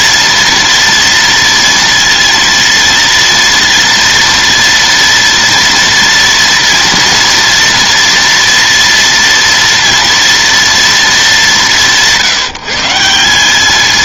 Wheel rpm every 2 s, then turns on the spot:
230, 230, 230, 230, 230, 210, 190.
none